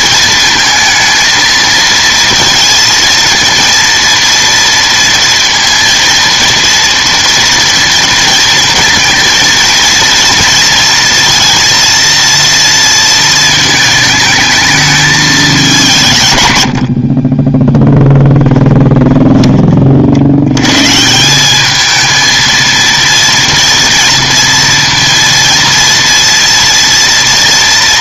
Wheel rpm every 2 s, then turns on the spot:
230, 230, 230, 230, 230, 230, 230, 220, 100, 10, 110, 230, 230, 230.
18-20